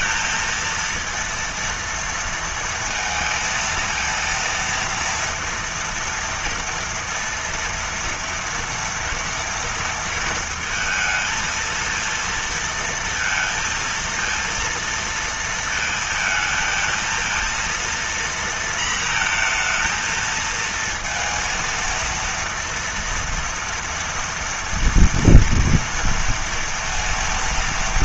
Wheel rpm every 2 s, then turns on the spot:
230, 230, 230, 230, 230, 230, 230, 230, 220, 230, 230, 230, 240, 230.
none